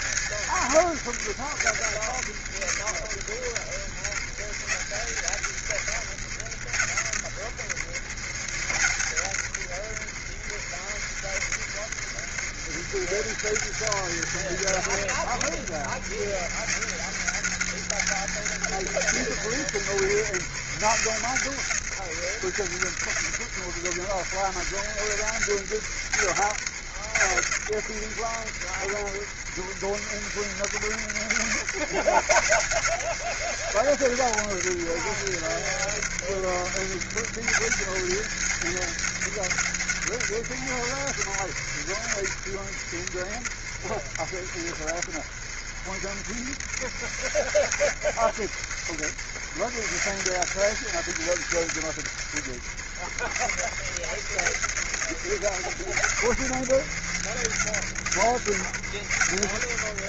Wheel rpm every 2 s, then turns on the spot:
90, 80, 80, 80, 80, 70, 90, 90, 90, 100, 80, 90, 90, 80, 70, 70, 90, 90, 80, 100, 80, 70, 60, 70, 70, 90, 70, 80, 80, 80.
none